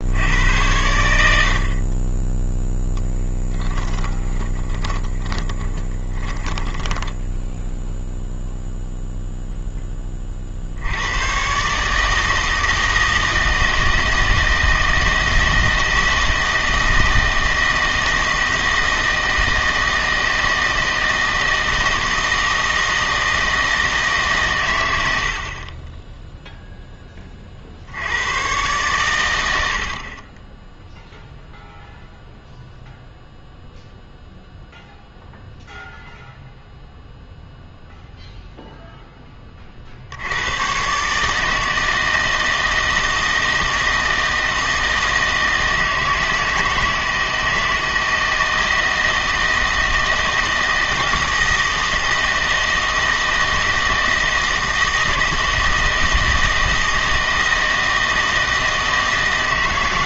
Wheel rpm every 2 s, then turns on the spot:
90, 0, 10, 10, 0, 70, 160, 160, 160, 160, 160, 160, 100, 0, 120, 10, 0, 0, 0, 0, 110, 160, 160, 160, 160, 160, 160, 160, 160, 160.
4-8